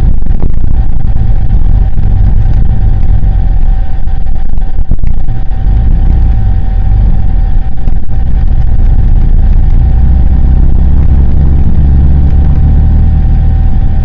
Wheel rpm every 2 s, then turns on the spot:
0, 0, 0, 0, 0, 0, 0.
none